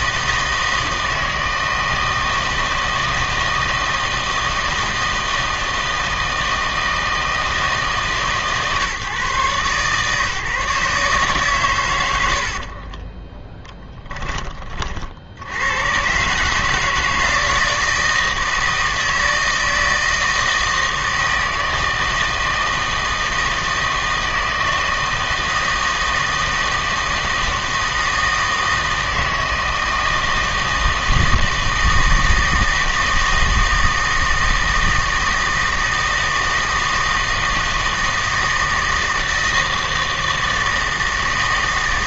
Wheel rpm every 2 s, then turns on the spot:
160, 160, 160, 160, 150, 150, 60, 30, 150, 160, 160, 160, 160, 160, 160, 160, 160, 160, 160, 160, 160.
12-14